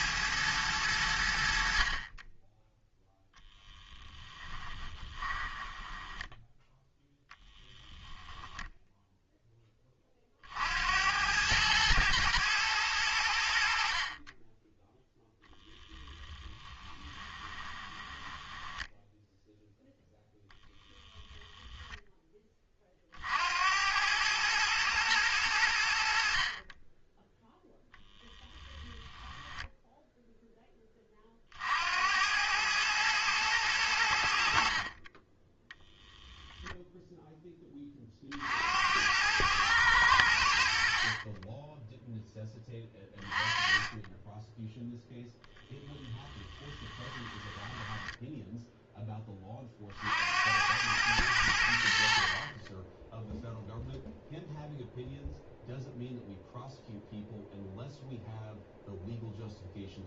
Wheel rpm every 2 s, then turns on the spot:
100, 10, 20, 0, 0, 70, 110, 10, 20, 10, 20, 40, 110, 30, 10, 20, 110, 50, 0, 80, 60, 20, 0, 10, 10, 100, 20, 0, 0, 0.
4-6 16-22 46-48